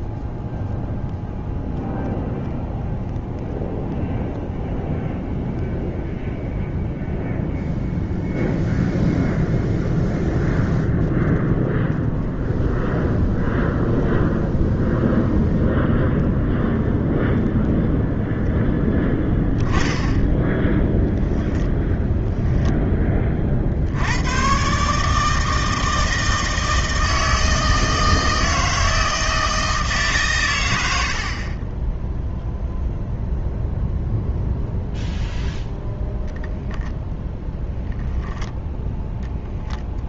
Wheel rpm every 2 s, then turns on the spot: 0, 0, 0, 0, 0, 0, 0, 0, 0, 0, 10, 10, 130, 160, 160, 100, 0, 0, 0, 0.
20-22